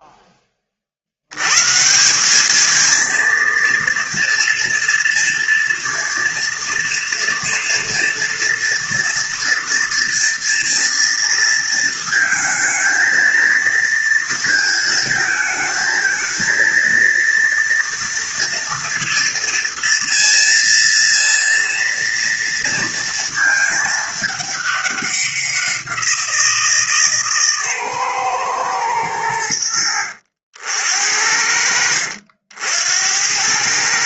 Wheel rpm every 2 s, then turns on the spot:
30, 210, 230, 230, 230, 230, 220, 230, 230, 230, 230, 230, 200, 160, 120, 70, 70.
none